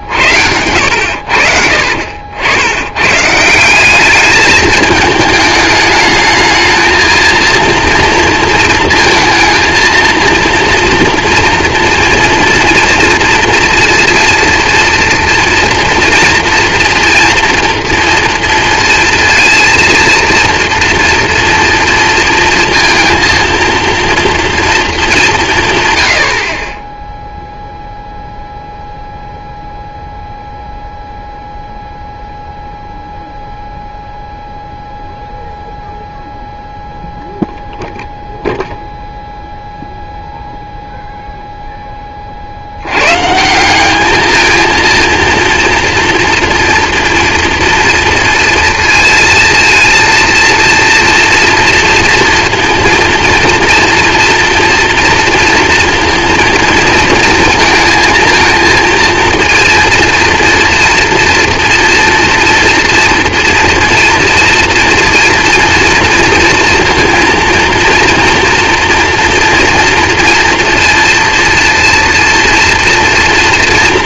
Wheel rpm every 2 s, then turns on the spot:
70, 90, 210, 220, 230, 230, 230, 230, 230, 230, 240, 230, 230, 30, 0, 0, 0, 0, 0, 0, 0, 60, 220, 230, 230, 230, 230, 230, 230, 230, 230, 230, 230, 230, 230, 230, 230.
0-2